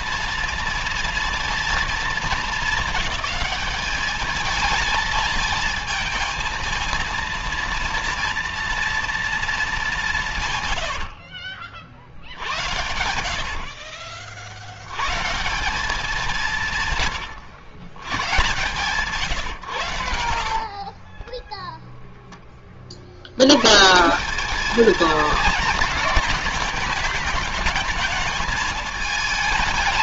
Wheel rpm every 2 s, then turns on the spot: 230, 220, 220, 230, 230, 140, 80, 70, 170, 130, 60, 20, 210, 210, 210.
12-14 20-22